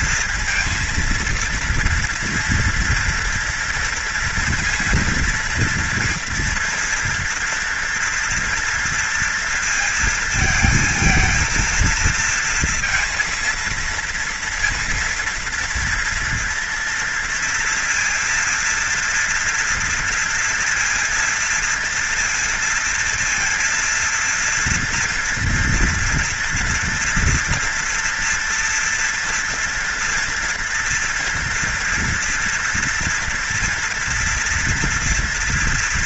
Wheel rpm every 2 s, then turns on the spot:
230, 240, 230, 230, 230, 230, 230, 230, 230, 230, 230, 230, 230, 240, 230, 240, 240, 230.
none